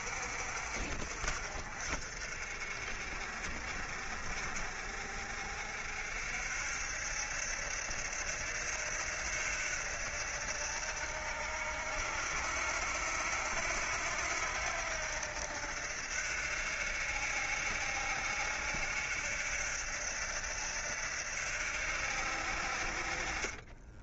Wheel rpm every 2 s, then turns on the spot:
50, 50, 50, 70, 80, 70, 80, 80, 70, 70, 70, 50.
none